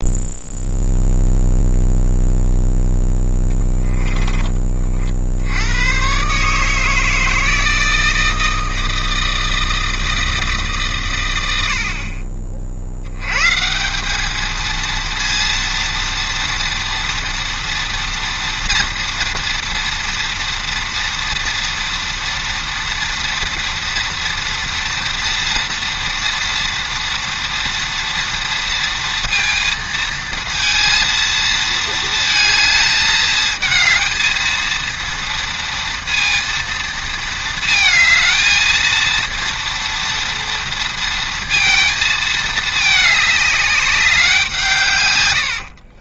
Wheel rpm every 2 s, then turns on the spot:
0, 0, 20, 150, 160, 150, 60, 220, 240, 230, 230, 230, 230, 230, 230, 230, 220, 230, 230, 230, 230, 210, 160.
none